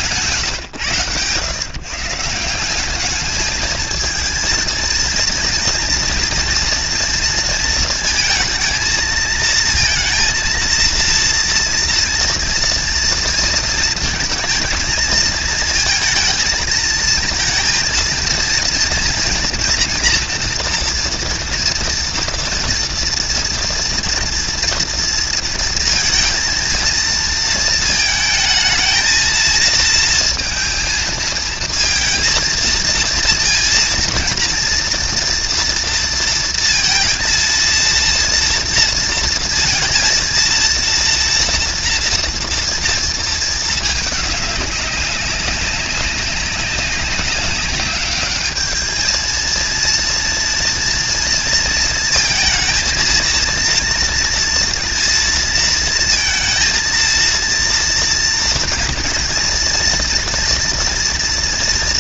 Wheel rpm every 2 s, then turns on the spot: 140, 180, 230, 230, 220, 230, 230, 230, 220, 230, 230, 240, 240, 230, 220, 230, 230, 230, 230, 230, 230, 230, 200, 200, 210, 230, 230, 230, 220, 230, 230.
none